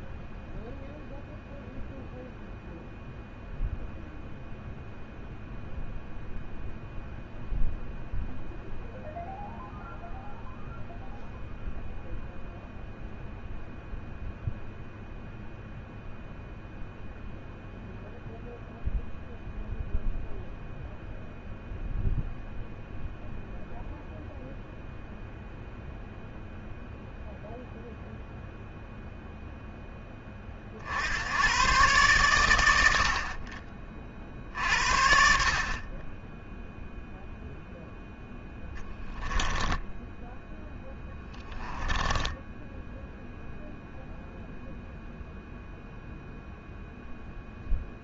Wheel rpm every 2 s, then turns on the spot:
0, 0, 0, 0, 0, 0, 0, 0, 0, 0, 0, 0, 0, 0, 0, 40, 70, 60, 0, 0, 10, 10, 0, 0.
42-44